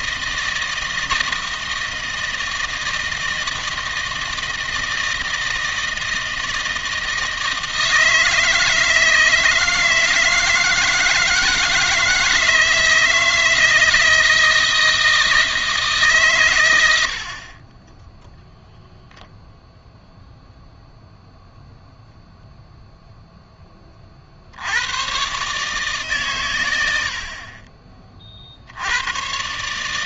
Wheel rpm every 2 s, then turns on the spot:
160, 160, 160, 160, 160, 160, 160, 160, 100, 0, 0, 0, 90, 90, 70.
none